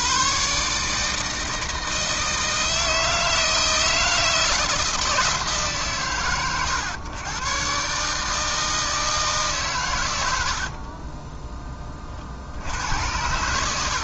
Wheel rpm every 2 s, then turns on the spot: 150, 160, 160, 110, 160, 50, 90.
10-12